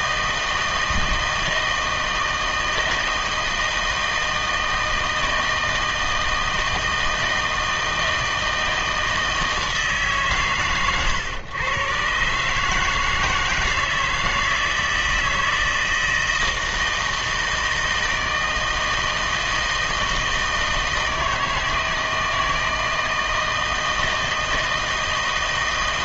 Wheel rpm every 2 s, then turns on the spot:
160, 160, 160, 160, 160, 120, 150, 160, 160, 160, 160, 160, 160.
none